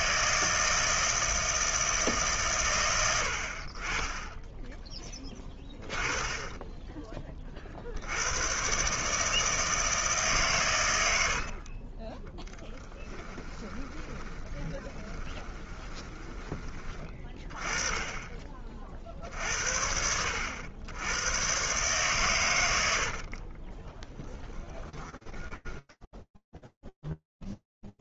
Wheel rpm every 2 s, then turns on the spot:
160, 140, 20, 20, 90, 140, 20, 20, 20, 30, 70, 130, 20, 0.
12-18 24-26